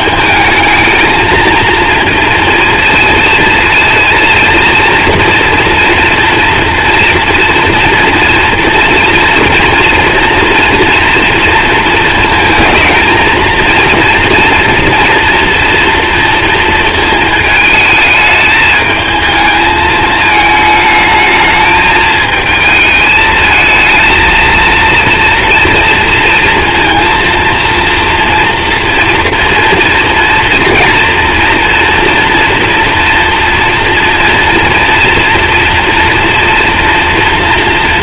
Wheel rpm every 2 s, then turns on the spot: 220, 230, 230, 230, 230, 240, 220, 230, 230, 210, 220, 220, 230, 230, 230, 230, 230, 230, 230.
none